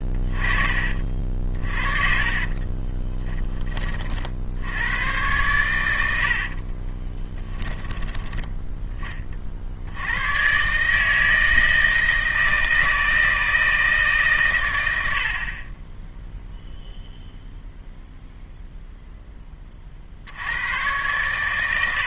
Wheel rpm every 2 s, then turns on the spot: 30, 30, 80, 50, 10, 130, 160, 120, 0, 0, 100.
2-4 6-8